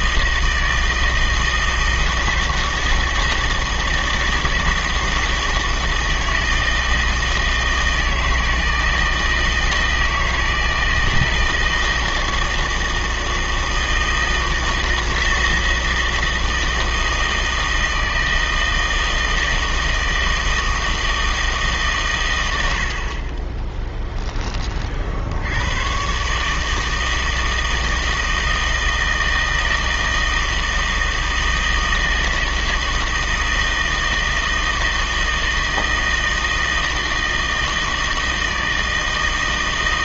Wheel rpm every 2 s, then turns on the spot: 160, 160, 160, 160, 160, 160, 160, 160, 160, 160, 160, 90, 30, 150, 160, 160, 160, 160, 160, 160.
none